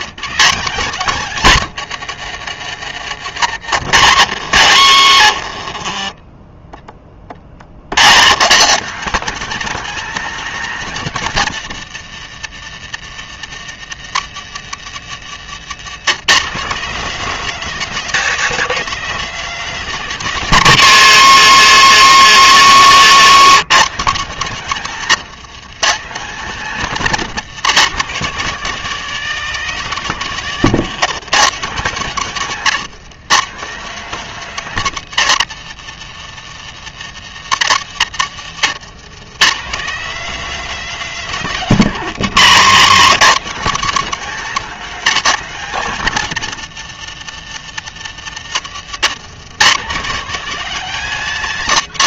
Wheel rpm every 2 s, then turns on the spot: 200, 140, 90, 30, 160, 220, 130, 150, 200, 240, 180, 150, 180, 190, 220, 190, 170, 200, 120, 110, 240, 170, 230, 150, 120, 230.
22-24 30-32 38-40 48-50